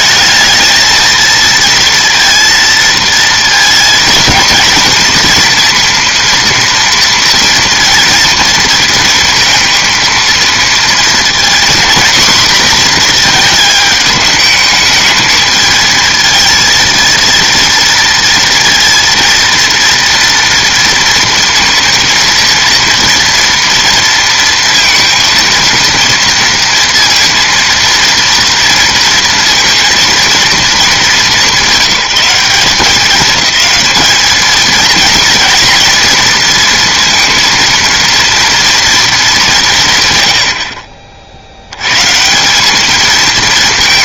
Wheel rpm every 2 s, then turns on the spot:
220, 230, 230, 230, 230, 230, 240, 220, 230, 230, 230, 230, 230, 230, 230, 200, 200, 230, 230, 230, 40, 200.
none